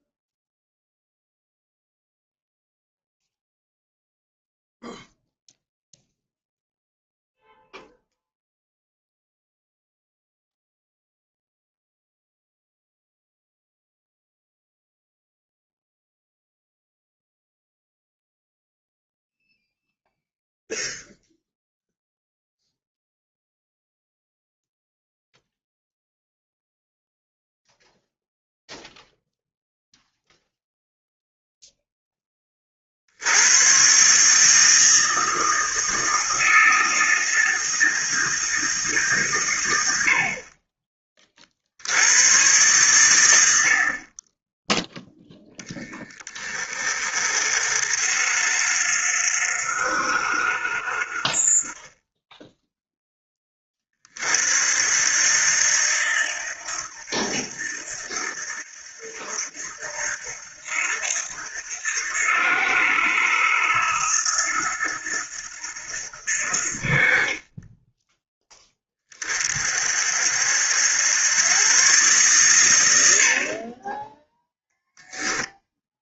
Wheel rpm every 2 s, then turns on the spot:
0, 0, 0, 0, 0, 0, 0, 0, 0, 0, 0, 0, 0, 0, 0, 0, 50, 160, 160, 160, 30, 110, 10, 30, 60, 50, 10, 60, 80, 80, 80, 80, 80, 50, 10, 80, 110, 10.
74-76